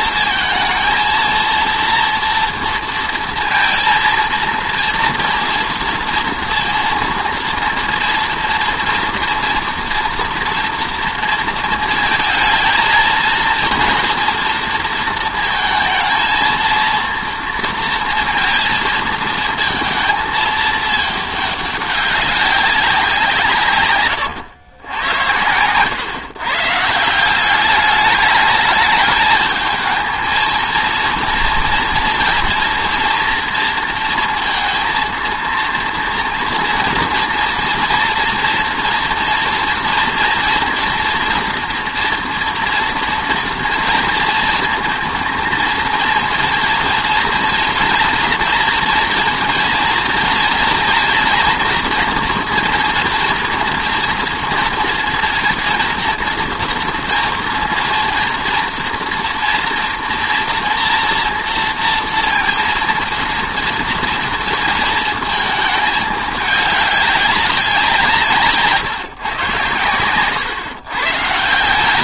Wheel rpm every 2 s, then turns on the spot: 230, 230, 230, 230, 230, 230, 230, 230, 230, 230, 220, 200, 130, 130, 210, 220, 230, 230, 230, 240, 230, 230, 230, 230, 230, 230, 240, 230, 230, 230, 240, 230, 230, 210, 150, 130.
none